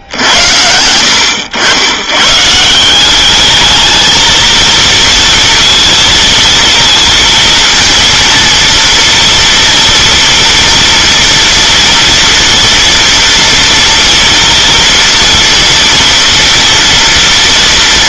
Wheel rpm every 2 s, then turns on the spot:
70, 150, 230, 230, 230, 230, 230, 230, 230.
none